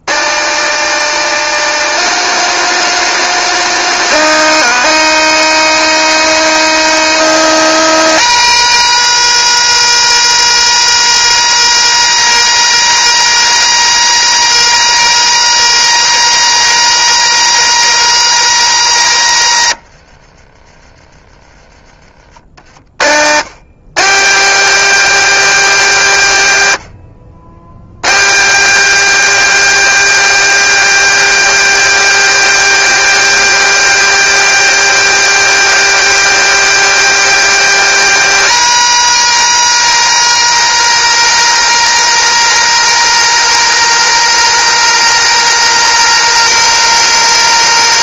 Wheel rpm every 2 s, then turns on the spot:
120, 160, 150, 150, 200, 220, 220, 220, 220, 220, 90, 70, 180, 140, 170, 230, 230, 230, 230, 230, 220, 220, 220, 220.
20-22